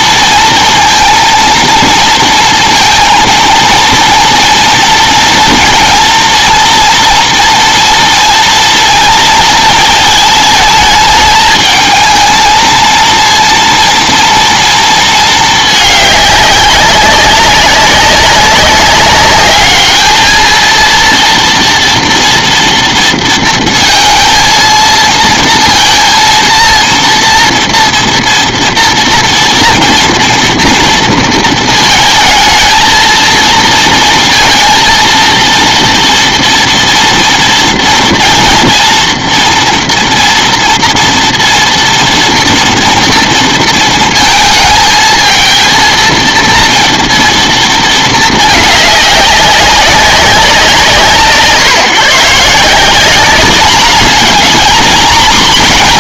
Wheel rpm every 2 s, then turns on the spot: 230, 230, 230, 230, 230, 220, 230, 230, 200, 200, 220, 230, 230, 230, 230, 230, 220, 230, 230, 230, 230, 230, 220, 230, 210, 180, 170, 220.
none